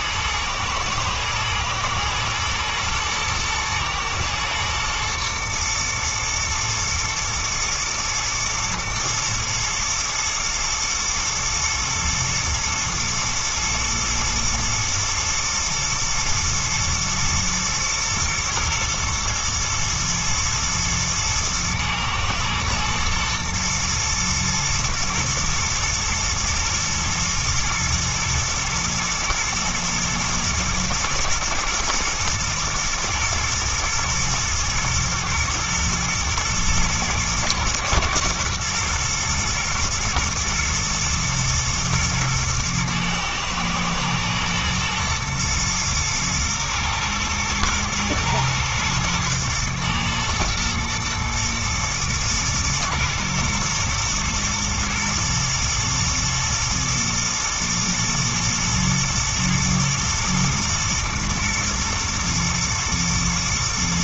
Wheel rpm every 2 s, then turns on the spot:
110, 120, 110, 120, 120, 110, 110, 110, 120, 110, 120, 120, 120, 110, 110, 120, 120, 120, 120, 120, 110, 110, 110, 110, 110, 120, 120, 120, 110, 120, 110, 110.
none